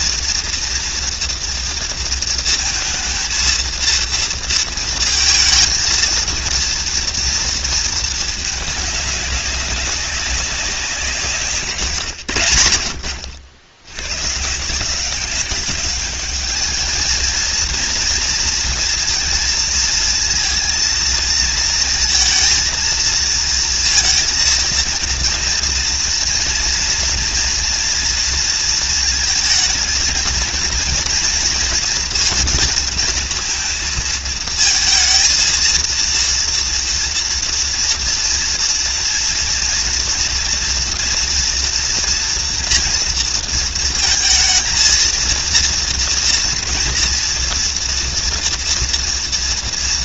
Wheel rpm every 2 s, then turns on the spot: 230, 220, 230, 230, 210, 190, 100, 150, 210, 230, 230, 230, 230, 230, 230, 230, 230, 230, 230, 230, 230, 230, 220, 230, 240.
none